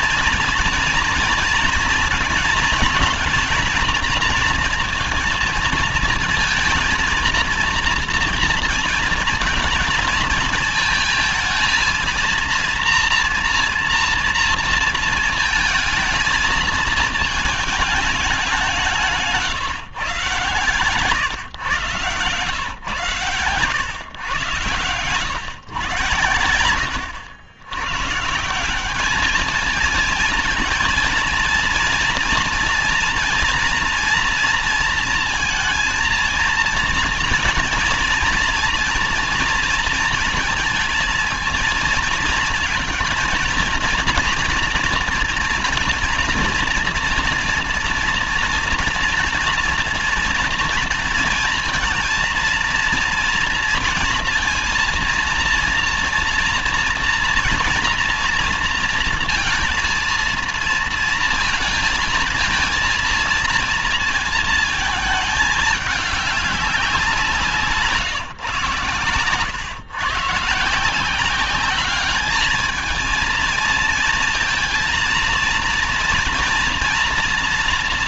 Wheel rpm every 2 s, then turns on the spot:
230, 220, 230, 220, 230, 220, 230, 230, 220, 190, 120, 120, 120, 110, 180, 230, 230, 230, 230, 230, 230, 230, 230, 230, 230, 230, 230, 230, 230, 230, 230, 230, 220, 200, 120, 150, 210, 230, 230.
none